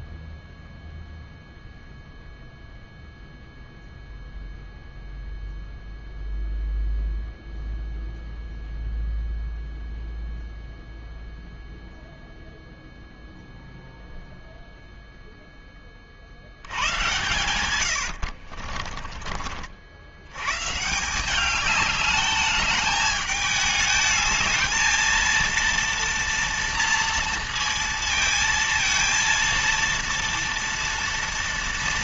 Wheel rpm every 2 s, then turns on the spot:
0, 0, 0, 0, 0, 0, 0, 0, 90, 40, 150, 210, 220, 230, 230, 230.
18-20